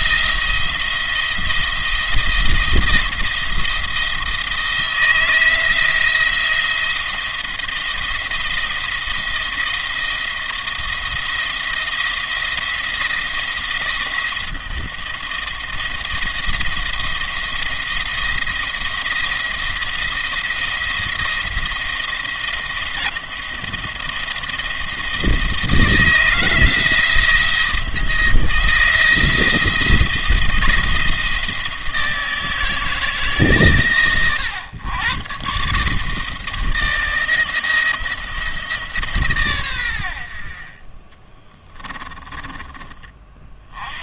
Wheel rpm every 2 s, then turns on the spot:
170, 170, 160, 170, 170, 170, 170, 170, 170, 170, 170, 170, 170, 170, 170, 160, 160, 110, 170, 150, 30, 30.
40-42